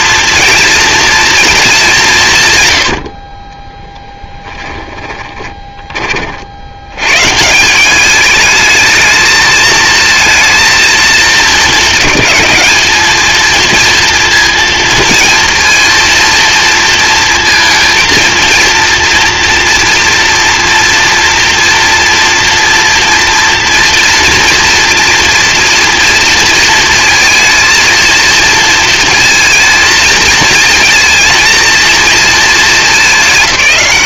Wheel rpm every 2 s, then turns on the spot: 230, 60, 10, 130, 220, 220, 220, 230, 230, 230, 230, 240, 230, 220, 230, 230, 210.
4-6